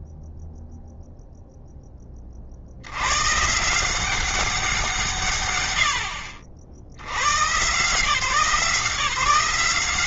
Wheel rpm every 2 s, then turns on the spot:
0, 70, 190, 70, 170.
none